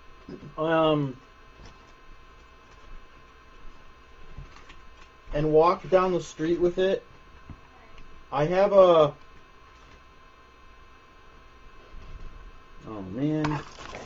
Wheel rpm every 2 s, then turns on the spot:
0, 0, 0, 0, 0, 0, 0.
none